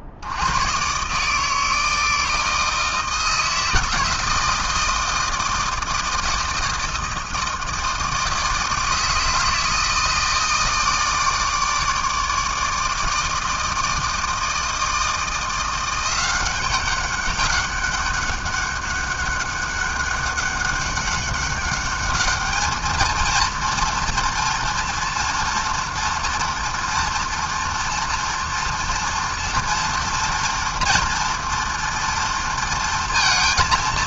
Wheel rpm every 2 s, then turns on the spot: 150, 160, 160, 160, 160, 160, 160, 170, 200, 200, 200, 230, 230, 230, 230, 230, 220.
none